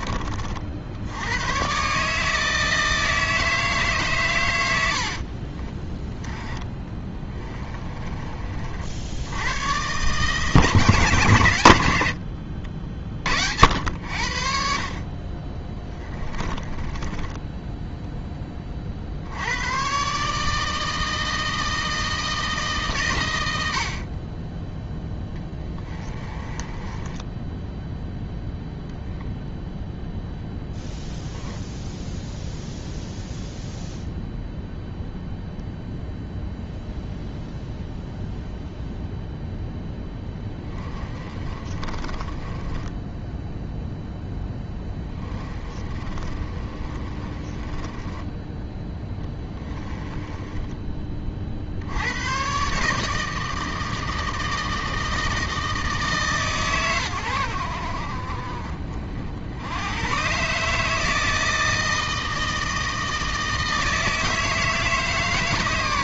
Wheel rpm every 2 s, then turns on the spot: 70, 160, 90, 20, 50, 140, 60, 40, 20, 50, 160, 150, 10, 20, 0, 0, 0, 0, 0, 0, 20, 10, 10, 30, 10, 20, 150, 160, 130, 40, 150, 160, 160.
4-8 16-18 26-28 40-48